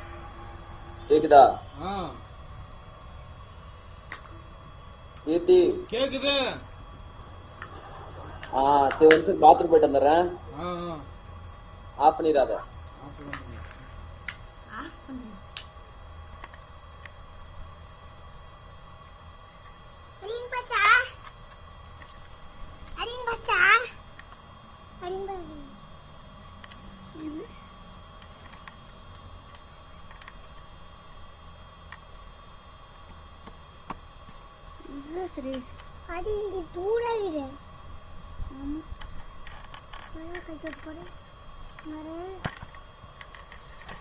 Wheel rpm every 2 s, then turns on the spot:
0, 0, 0, 0, 0, 0, 0, 0, 0, 0, 0, 0, 0, 0, 0, 0, 0, 0, 0, 0, 0, 0.
none